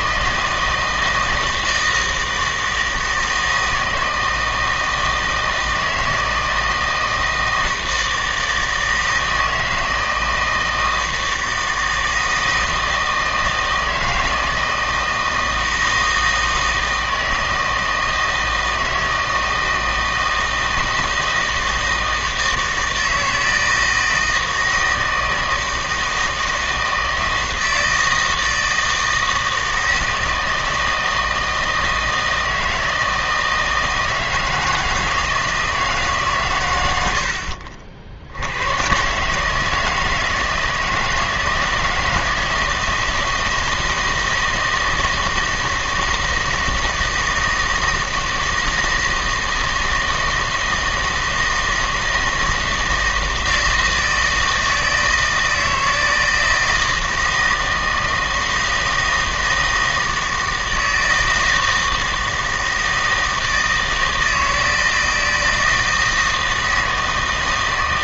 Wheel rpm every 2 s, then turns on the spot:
160, 160, 160, 160, 160, 160, 160, 160, 160, 160, 160, 160, 160, 160, 160, 160, 160, 160, 110, 100, 160, 160, 160, 160, 160, 160, 160, 160, 160, 160, 160, 160, 160, 160.
none